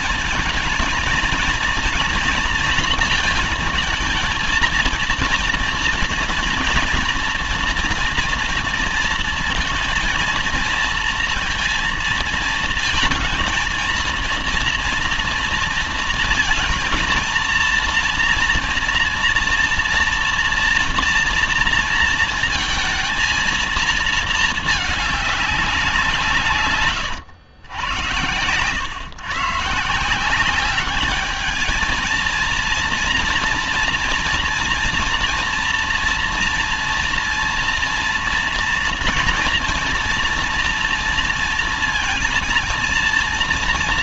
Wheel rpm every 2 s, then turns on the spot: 230, 230, 220, 230, 230, 230, 230, 240, 230, 230, 240, 230, 220, 140, 100, 190, 230, 230, 230, 230, 230, 230.
none